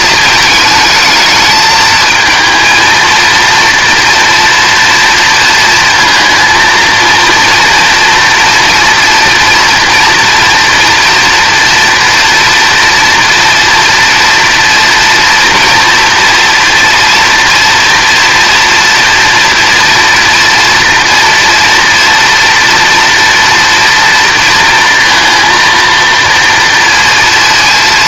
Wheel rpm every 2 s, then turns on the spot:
220, 230, 230, 230, 230, 230, 230, 240, 240, 240, 240, 230, 230, 230.
none